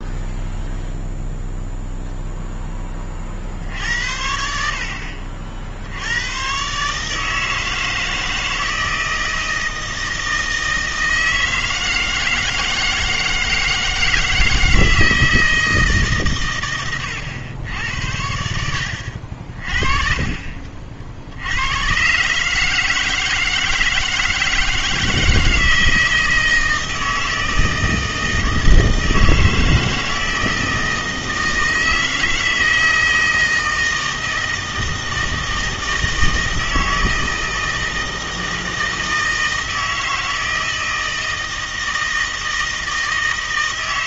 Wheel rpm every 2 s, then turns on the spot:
0, 10, 60, 140, 160, 160, 160, 160, 110, 70, 40, 160, 160, 160, 160, 160, 160, 160, 160, 160, 160, 160.
none